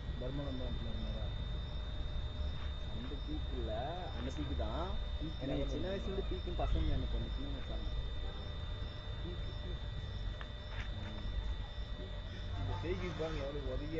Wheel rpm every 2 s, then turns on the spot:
0, 0, 0, 0, 0, 0, 0.
none